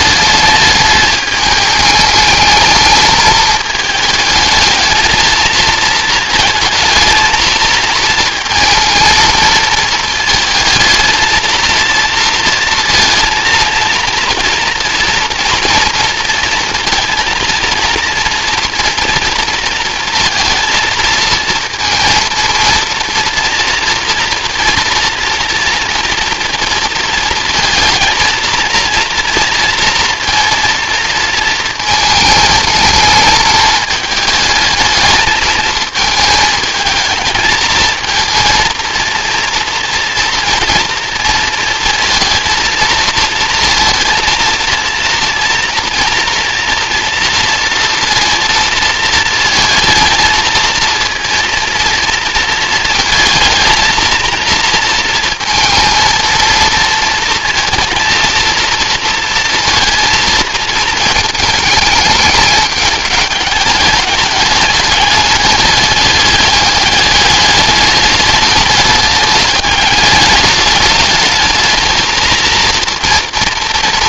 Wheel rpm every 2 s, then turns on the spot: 210, 220, 220, 230, 230, 220, 230, 230, 230, 230, 220, 230, 230, 230, 230, 230, 220, 220, 220, 230, 230, 230, 230, 230, 230, 230, 220, 230, 230, 230, 220, 210, 210, 200, 210, 210, 230.
none